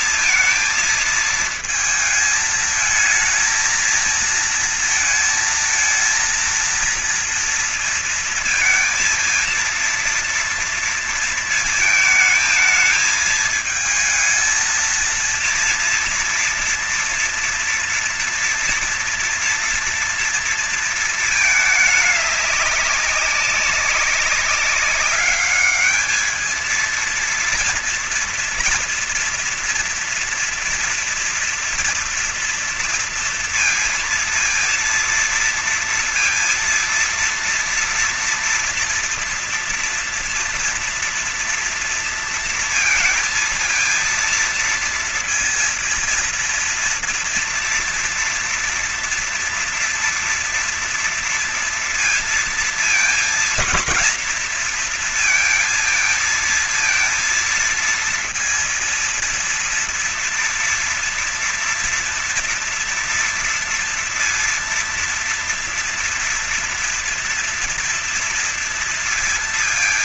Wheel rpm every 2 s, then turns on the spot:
220, 220, 230, 230, 230, 230, 220, 220, 230, 230, 230, 210, 200, 220, 230, 230, 230, 230, 230, 230, 230, 230, 230, 230, 230, 230, 230, 230, 220, 230, 230, 230, 230, 230, 230.
none